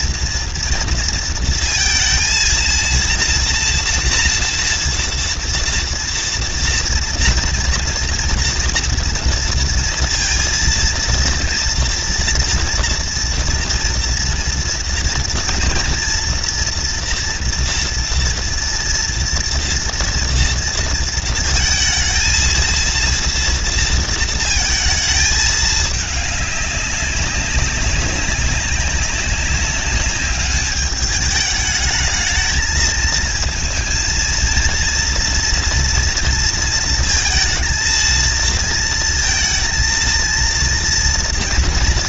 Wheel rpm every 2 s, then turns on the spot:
230, 230, 230, 230, 240, 230, 230, 230, 240, 230, 230, 230, 230, 210, 190, 200, 220, 230, 230, 230, 230.
none